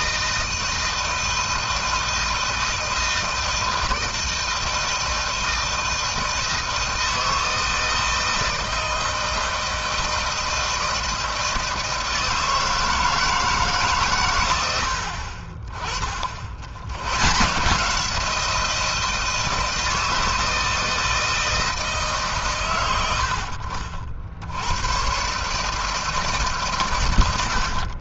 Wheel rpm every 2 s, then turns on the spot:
160, 160, 160, 160, 160, 160, 160, 70, 90, 170, 160, 110, 100, 140.
none